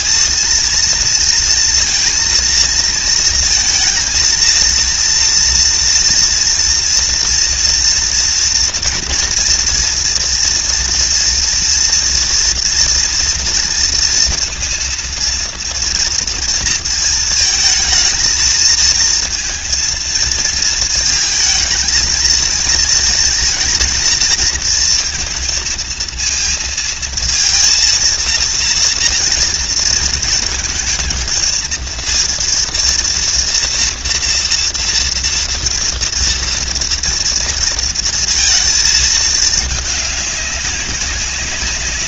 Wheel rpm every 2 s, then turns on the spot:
230, 230, 230, 230, 230, 230, 230, 230, 230, 230, 220, 230, 230, 230, 230, 230, 230, 230, 240, 220, 190.
none